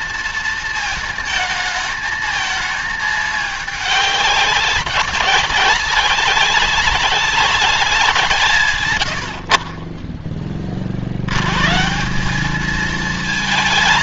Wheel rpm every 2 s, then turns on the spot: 230, 220, 200, 200, 180, 30, 190.
none